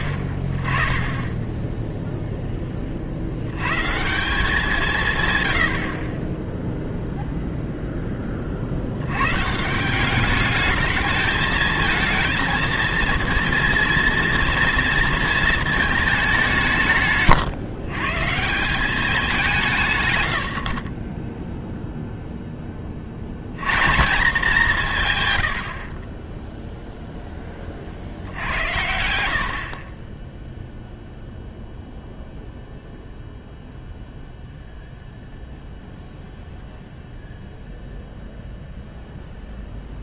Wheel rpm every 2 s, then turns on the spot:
40, 10, 180, 0, 50, 210, 220, 230, 170, 180, 50, 20, 200, 0, 90, 0, 0, 0, 0, 0.
none